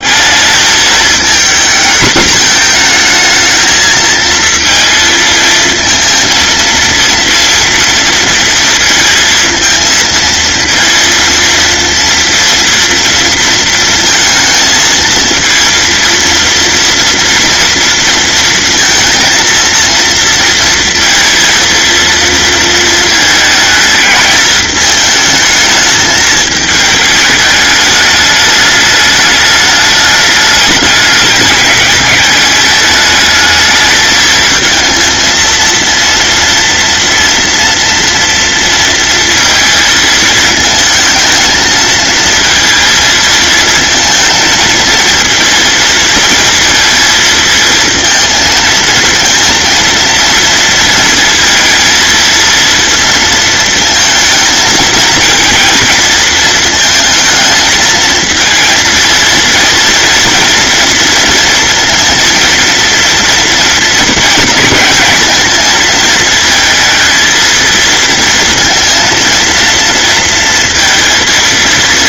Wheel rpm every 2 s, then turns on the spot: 220, 230, 230, 230, 230, 230, 230, 230, 230, 230, 230, 220, 220, 220, 210, 210, 210, 230, 230, 230, 220, 220, 230, 230, 230, 230, 230, 220, 220, 230, 230, 230, 220, 220, 230, 230.
none